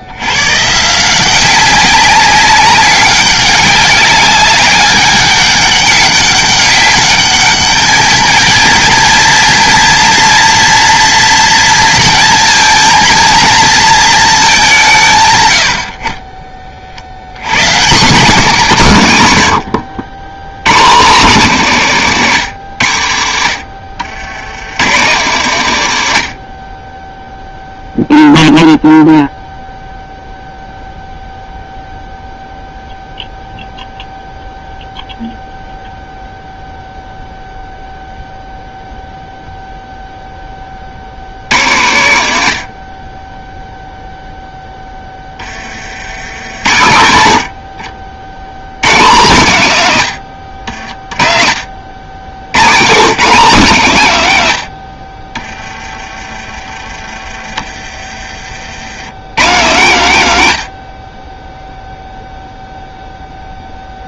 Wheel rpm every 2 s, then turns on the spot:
110, 190, 200, 200, 220, 230, 230, 210, 50, 200, 110, 120, 110, 40, 0, 0, 0, 0, 0, 0, 40, 60, 10, 110, 130, 60, 130, 80, 30, 80, 90, 0.
none